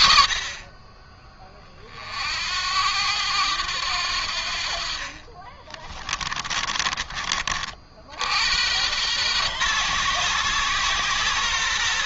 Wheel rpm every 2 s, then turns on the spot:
40, 80, 60, 20, 100, 130.
none